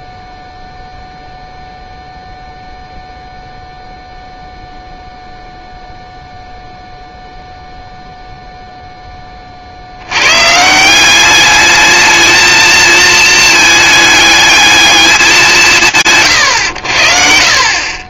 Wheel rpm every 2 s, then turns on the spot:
0, 0, 0, 0, 0, 170, 220, 210, 110.
none